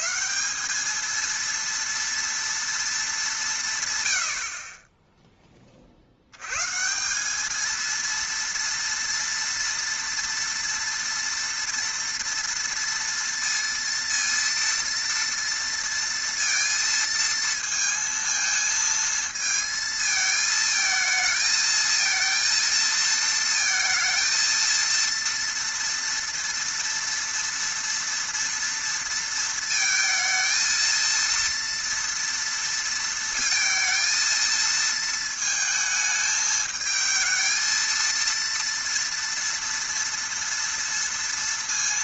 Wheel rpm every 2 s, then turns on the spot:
220, 230, 40, 100, 230, 230, 230, 230, 230, 230, 220, 230, 230, 230, 230, 230, 230, 220, 220, 230, 230.
none